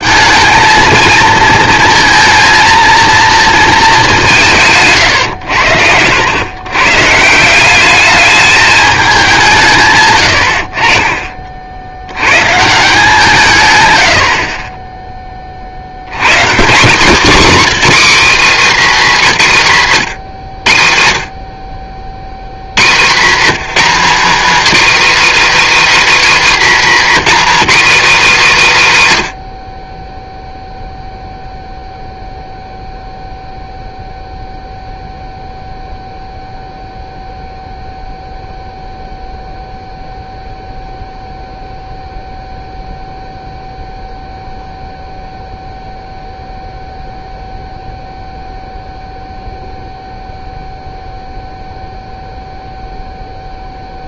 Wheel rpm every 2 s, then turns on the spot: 230, 230, 160, 150, 210, 60, 150, 20, 180, 240, 90, 140, 280, 280, 190, 0, 0, 0, 0, 0, 0, 0, 0, 0, 0, 0, 0.
4-6 22-24